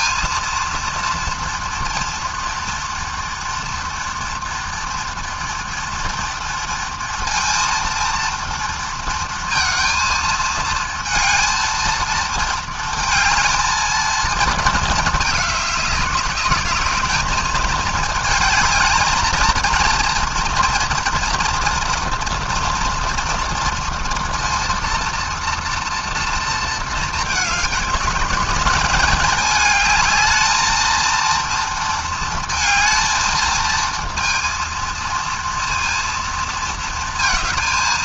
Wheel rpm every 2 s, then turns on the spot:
230, 230, 230, 230, 230, 230, 220, 220, 210, 220, 230, 230, 230, 220, 210, 220, 220, 230, 220.
none